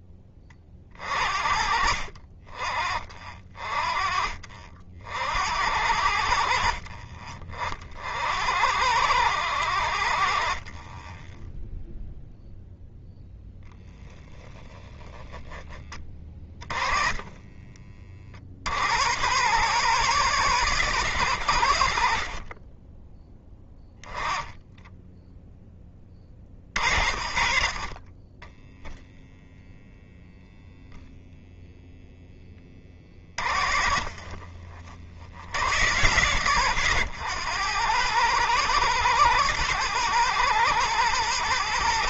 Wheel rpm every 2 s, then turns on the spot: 40, 40, 60, 40, 90, 30, 0, 10, 20, 100, 90, 10, 10, 50, 0, 0, 50, 70, 90, 110, 110.
16-18 32-34